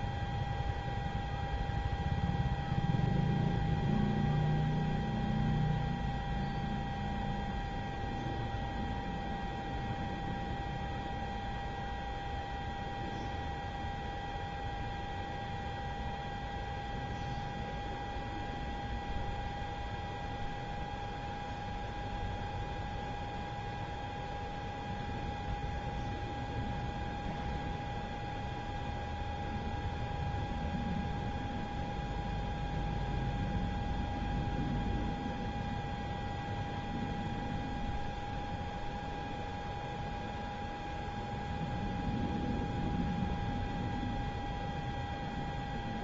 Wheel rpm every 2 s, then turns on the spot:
0, 0, 0, 0, 0, 0, 0, 0, 0, 0, 0, 0, 0, 0, 0, 0, 0, 0, 0, 0, 0, 0, 0.
none